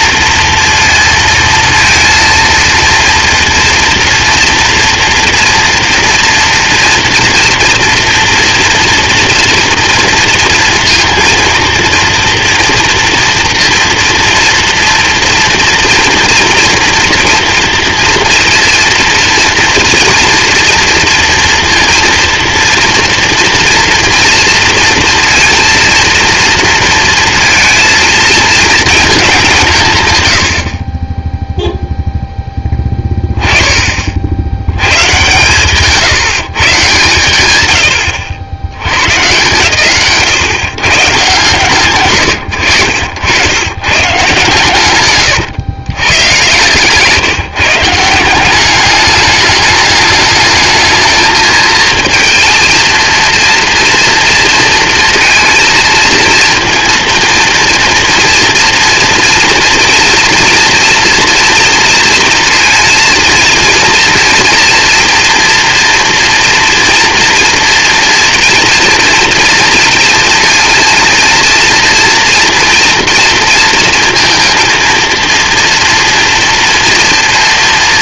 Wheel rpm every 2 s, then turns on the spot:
230, 230, 230, 230, 230, 230, 230, 230, 230, 230, 230, 230, 230, 230, 220, 70, 10, 90, 140, 80, 130, 90, 150, 130, 190, 220, 230, 230, 230, 230, 230, 230, 230, 230, 240, 230, 230, 230, 230.
30-32 46-48